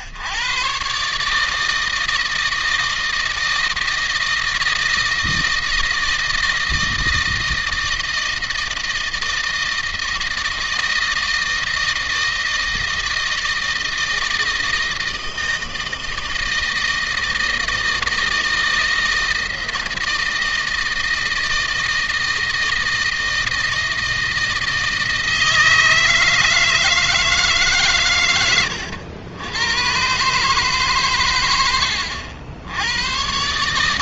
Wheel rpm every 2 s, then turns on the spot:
140, 160, 160, 160, 160, 160, 160, 160, 160, 160, 160, 160, 160, 160, 90, 130, 90.
none